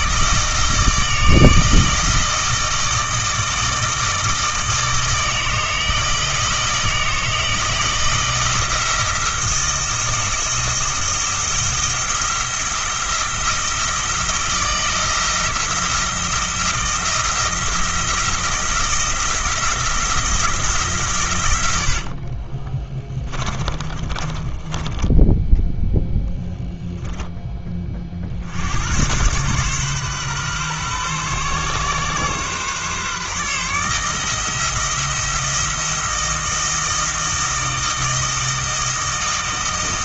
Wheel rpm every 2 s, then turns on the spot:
160, 160, 160, 160, 160, 160, 170, 170, 170, 170, 160, 40, 30, 0, 60, 130, 130, 160, 160, 160.
22-26